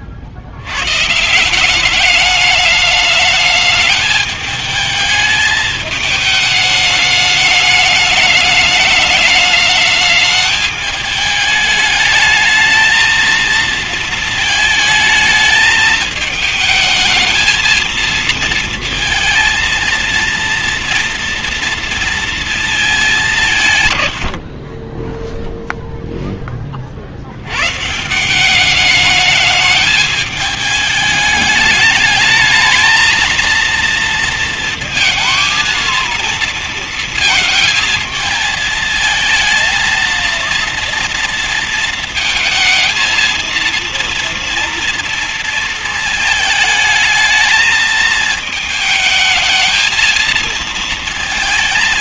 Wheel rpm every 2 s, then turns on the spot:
90, 210, 220, 210, 210, 210, 220, 220, 210, 220, 230, 220, 40, 30, 200, 210, 220, 230, 230, 220, 230, 220, 230, 220, 220, 220.
none